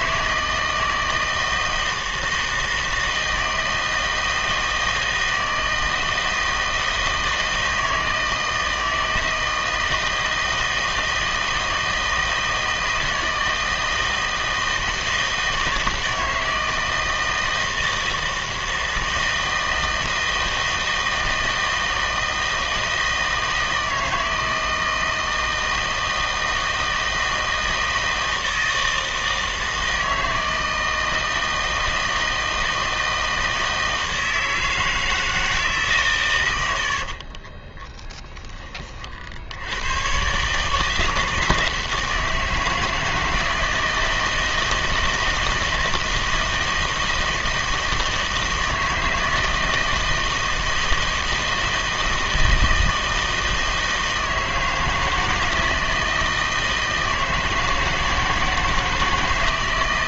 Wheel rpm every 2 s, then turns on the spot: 160, 160, 160, 160, 160, 160, 160, 160, 160, 160, 160, 160, 160, 160, 160, 160, 160, 160, 90, 20, 150, 160, 160, 160, 160, 160, 160, 160, 160, 160.
none